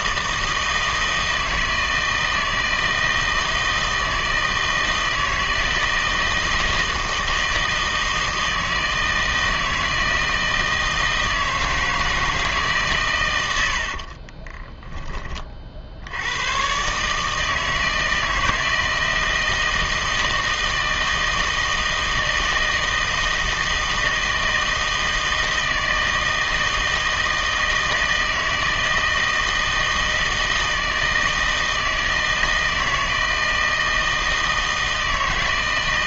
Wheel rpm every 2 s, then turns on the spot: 160, 160, 160, 160, 160, 160, 160, 20, 110, 160, 160, 160, 160, 160, 160, 160, 160, 160.
14-16